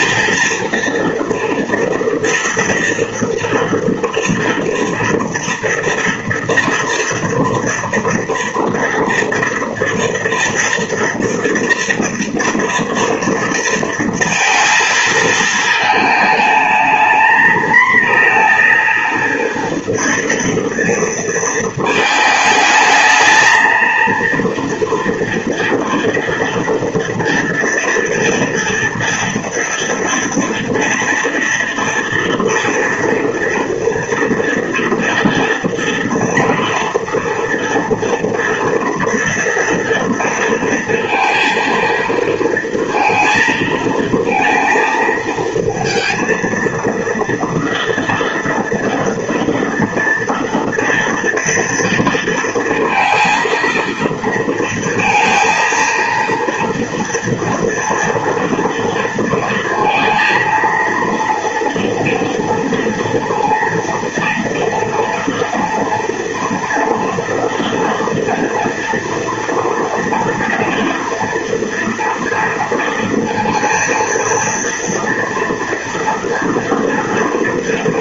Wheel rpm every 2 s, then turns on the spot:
240, 230, 230, 230, 230, 230, 240, 230, 210, 230, 230, 220, 230, 230, 230, 240, 230, 230, 230, 230, 230, 230, 230, 230, 230, 230, 230, 230, 230, 230, 230, 230, 230, 230, 230, 240, 230, 230, 230.
none